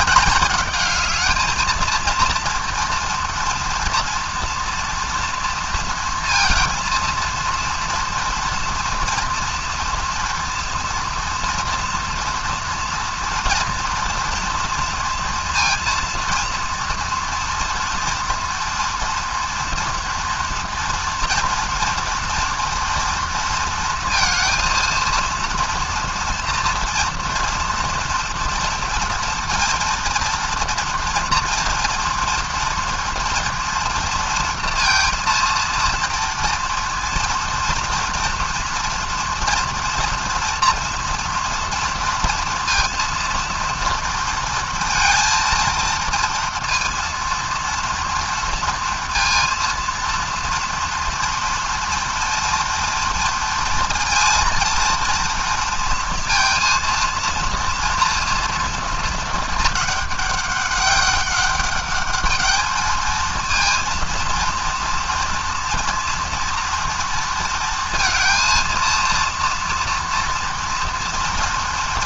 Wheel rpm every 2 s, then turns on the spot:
210, 230, 240, 230, 230, 230, 230, 230, 230, 230, 230, 230, 230, 240, 240, 230, 240, 230, 230, 230, 230, 230, 230, 230, 230, 230, 230, 230, 230, 230, 200, 210, 230, 230, 230, 230.
none